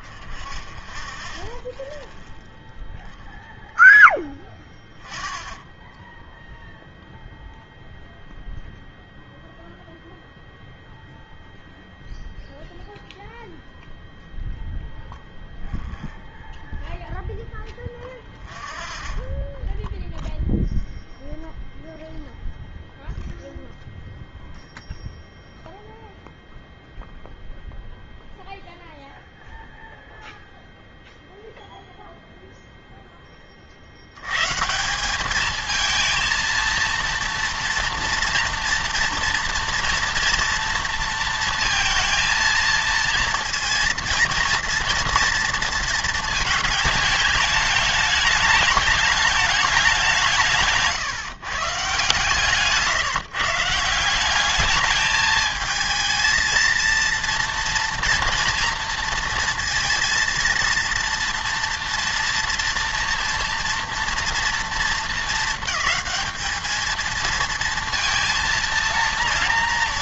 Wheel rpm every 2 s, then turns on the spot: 0, 0, 0, 0, 0, 0, 0, 0, 0, 0, 0, 0, 0, 0, 0, 0, 0, 170, 230, 230, 230, 230, 230, 210, 210, 160, 150, 210, 230, 230, 230, 230, 230, 220, 230.
none